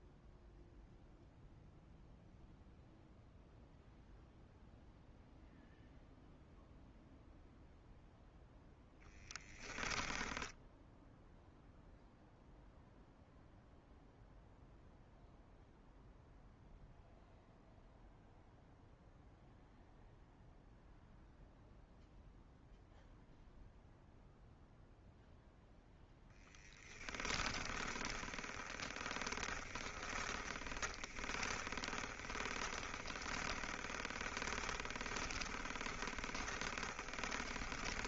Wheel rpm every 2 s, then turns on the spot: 0, 0, 0, 0, 0, 0, 0, 0, 0, 0, 0, 0, 0, 10, 20, 20, 20, 20, 30.
26-38